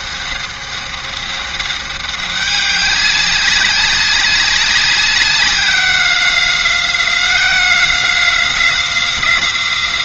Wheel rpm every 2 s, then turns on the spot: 200, 190, 190, 180, 180.
none